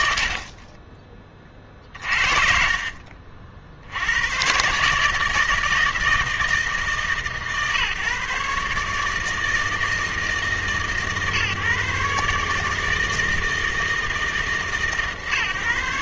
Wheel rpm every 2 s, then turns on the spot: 50, 50, 140, 160, 150, 140, 160, 140.
none